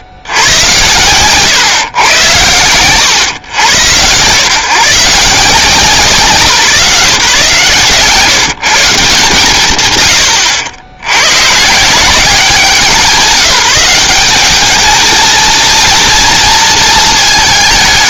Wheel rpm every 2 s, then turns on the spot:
70, 110, 140, 160, 170, 80, 170, 210, 230.
none